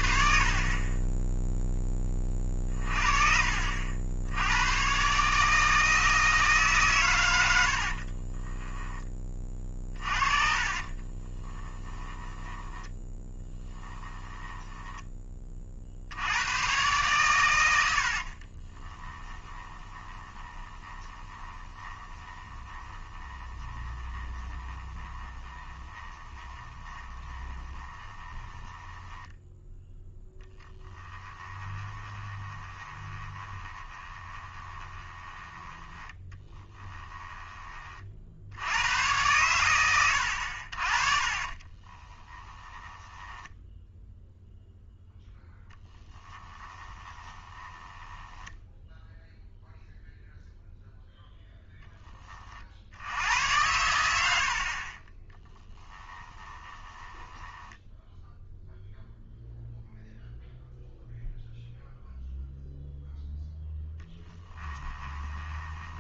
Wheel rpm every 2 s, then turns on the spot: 20, 50, 120, 140, 10, 30, 10, 10, 120, 20, 20, 20, 20, 20, 10, 20, 20, 20, 10, 100, 50, 10, 0, 20, 0, 0, 70, 30, 10, 0, 0, 0, 10.
10-14 18-38 42-44 46-48 56-58 64-66